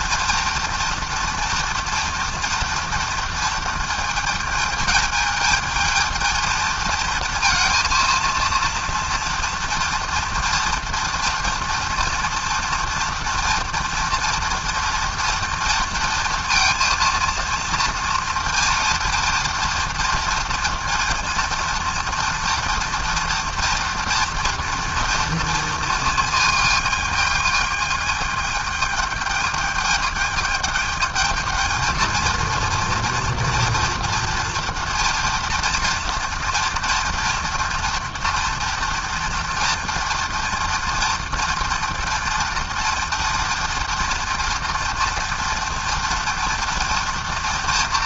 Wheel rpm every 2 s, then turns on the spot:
230, 230, 220, 230, 230, 230, 240, 230, 230, 230, 230, 230, 230, 220, 220, 220, 230, 230, 230, 230, 230, 230, 230, 230.
none